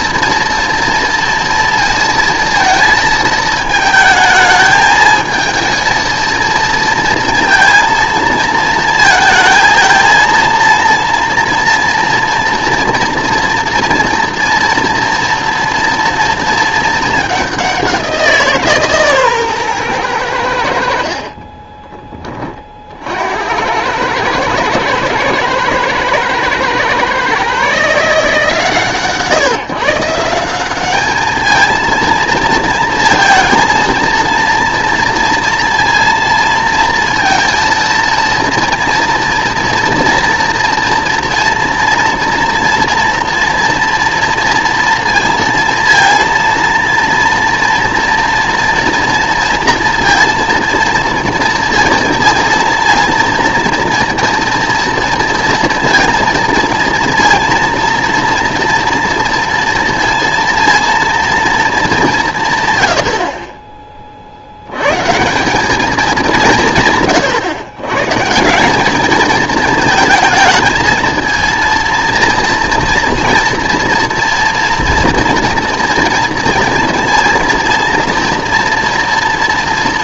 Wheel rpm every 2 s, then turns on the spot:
230, 230, 220, 230, 230, 230, 230, 230, 220, 160, 90, 40, 110, 120, 140, 190, 230, 230, 230, 230, 240, 230, 230, 230, 240, 230, 230, 230, 230, 230, 230, 140, 90, 160, 180, 220, 230, 230, 230, 230.
none